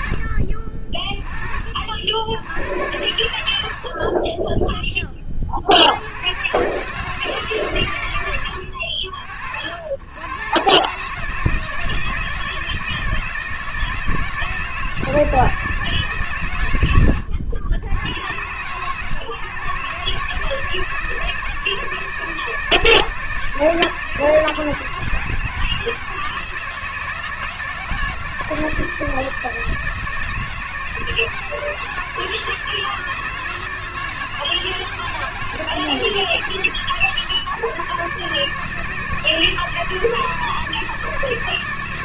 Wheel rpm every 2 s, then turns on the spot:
40, 90, 20, 150, 70, 160, 160, 160, 80, 130, 160, 160, 160, 160, 160, 160, 160, 160, 150, 160, 160.
none